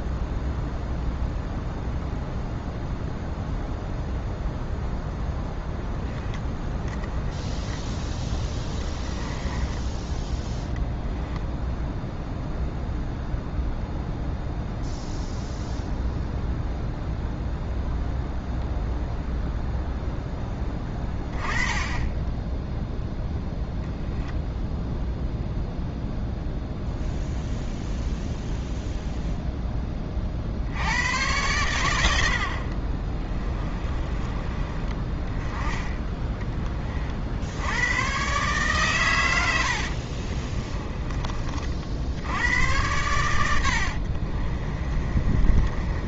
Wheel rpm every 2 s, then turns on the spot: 0, 0, 0, 10, 10, 10, 0, 0, 0, 0, 20, 0, 0, 0, 0, 80, 50, 20, 30, 130, 20, 110, 30.
8-10 40-42 44-46